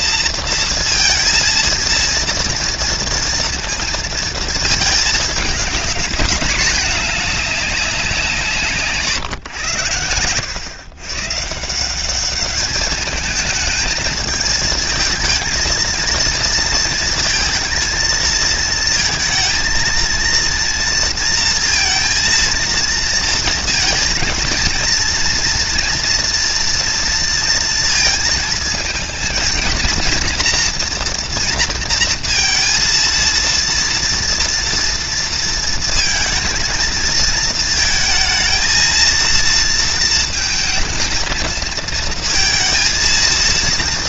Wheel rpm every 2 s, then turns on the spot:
230, 230, 220, 210, 150, 110, 210, 220, 230, 220, 230, 230, 230, 230, 220, 230, 230, 230, 220, 220, 220, 230.
none